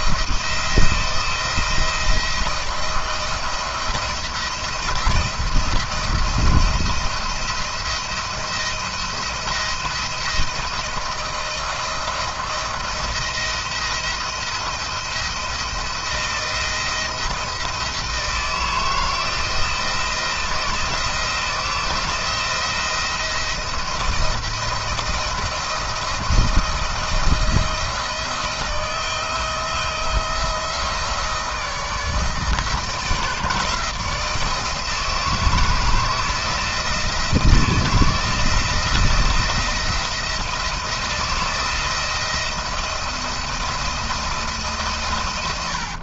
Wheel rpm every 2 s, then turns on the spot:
170, 170, 170, 170, 170, 170, 170, 170, 160, 160, 160, 170, 170, 170, 160, 160, 160, 160, 160, 170, 170, 170, 160.
none